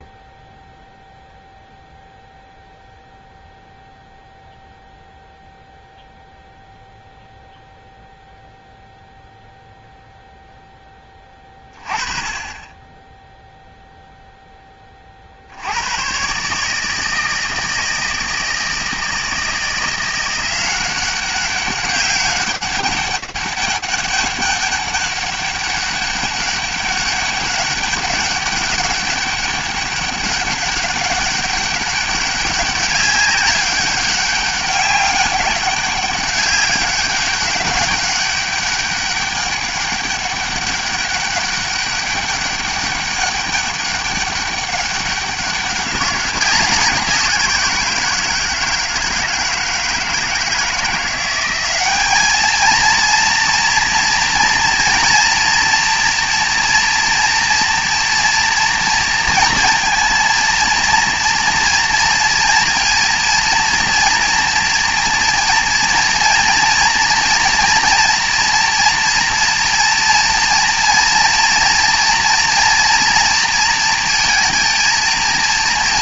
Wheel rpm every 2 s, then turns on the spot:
0, 0, 0, 0, 0, 0, 20, 10, 140, 160, 180, 200, 200, 200, 200, 200, 200, 200, 200, 200, 200, 200, 200, 190, 160, 160, 220, 230, 230, 230, 230, 230, 230, 230, 230, 230, 230, 230.
none